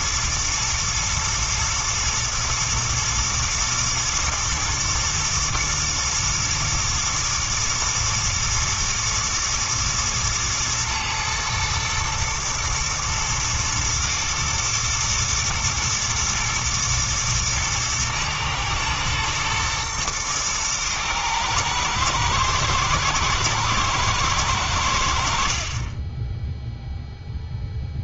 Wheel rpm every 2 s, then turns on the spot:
120, 120, 110, 110, 110, 110, 110, 110, 120, 110, 110, 110, 80, 0.
none